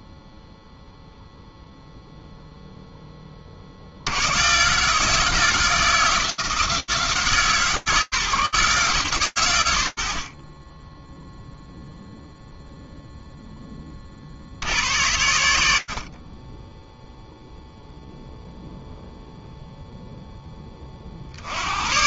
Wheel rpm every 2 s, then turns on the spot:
0, 0, 140, 140, 130, 0, 0, 80, 0, 0, 60.
none